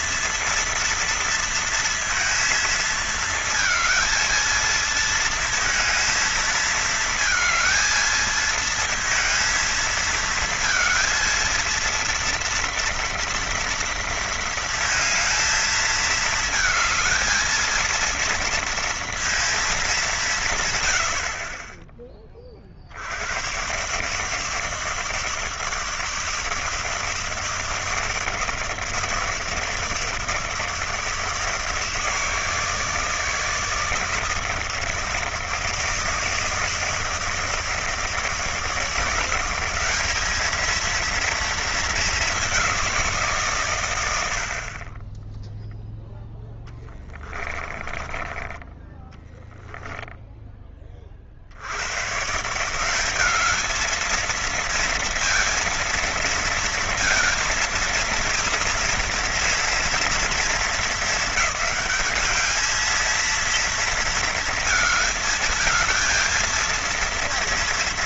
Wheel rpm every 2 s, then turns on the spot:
230, 230, 230, 230, 220, 230, 230, 220, 220, 230, 130, 50, 160, 160, 160, 160, 160, 160, 160, 170, 230, 180, 40, 20, 10, 20, 180, 230, 230, 230, 230, 220, 220, 230.
46-50